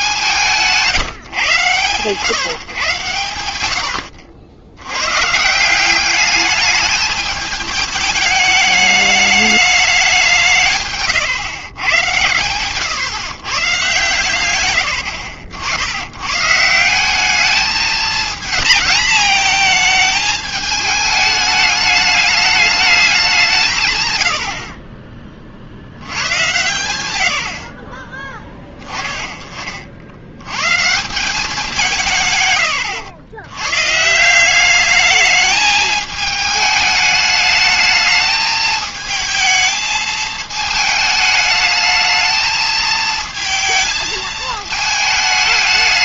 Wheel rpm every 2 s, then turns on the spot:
170, 130, 100, 210, 210, 130, 140, 110, 170, 230, 210, 210, 40, 110, 10, 120, 110, 200, 210, 220, 220, 220, 220.
10-12 24-26 32-34